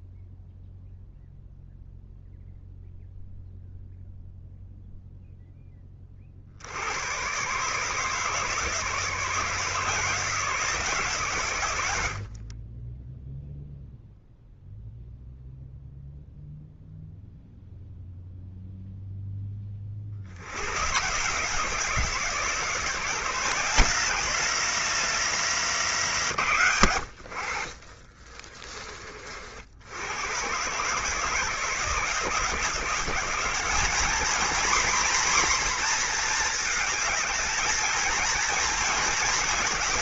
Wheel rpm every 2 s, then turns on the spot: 0, 0, 0, 90, 150, 160, 20, 0, 0, 0, 120, 170, 200, 110, 30, 140, 170, 240, 220, 230.
none